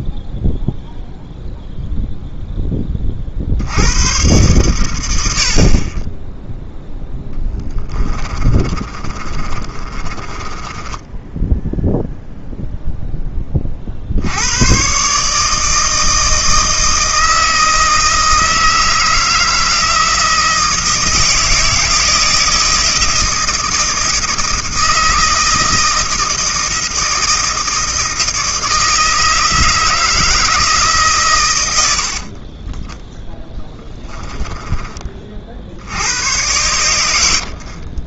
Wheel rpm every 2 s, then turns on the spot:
0, 10, 110, 0, 30, 20, 0, 130, 160, 160, 160, 160, 160, 160, 160, 140, 10, 30, 80.
8-12